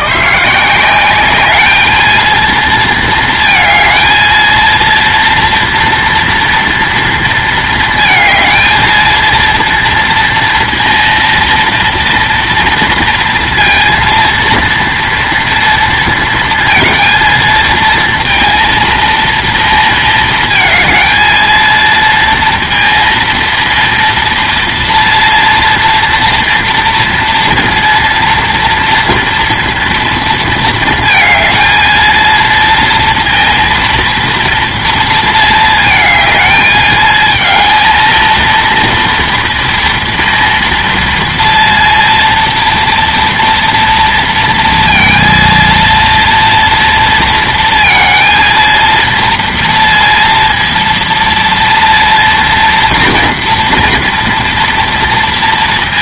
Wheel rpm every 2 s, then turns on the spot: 170, 230, 230, 230, 220, 230, 230, 230, 230, 230, 220, 230, 230, 230, 230, 230, 230, 230, 220, 230, 230, 230, 230, 230, 230, 230, 230, 230.
none